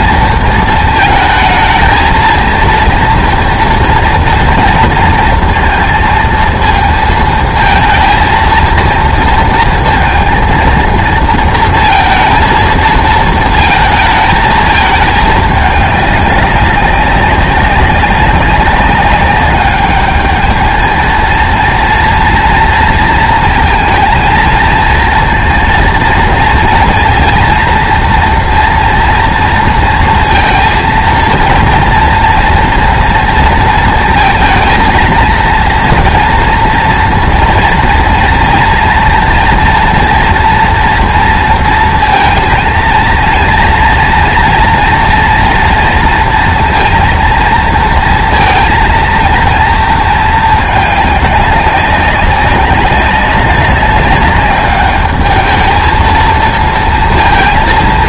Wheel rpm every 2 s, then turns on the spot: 230, 230, 230, 230, 230, 230, 230, 220, 190, 200, 220, 230, 230, 230, 230, 230, 230, 230, 230, 230, 230, 230, 240, 230, 230, 220, 200, 200, 230.
none